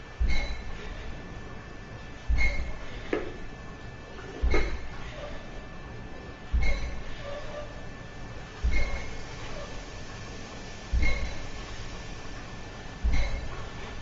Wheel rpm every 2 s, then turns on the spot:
0, 0, 0, 0, 0, 0, 0.
none